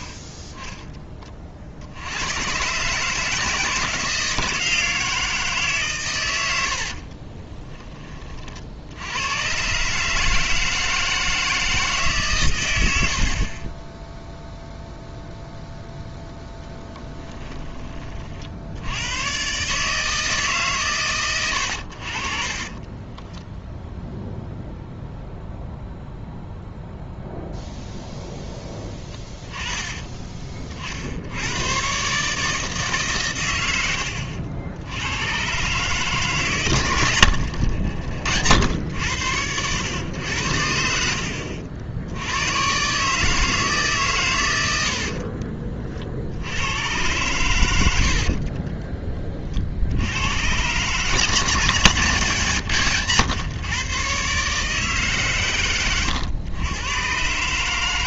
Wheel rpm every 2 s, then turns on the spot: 20, 130, 160, 80, 50, 160, 110, 0, 10, 80, 150, 40, 0, 0, 10, 50, 150, 90, 130, 90, 80, 120, 110, 90, 40, 120, 150, 150, 110.
6-8 16-18 22-24 44-46 48-50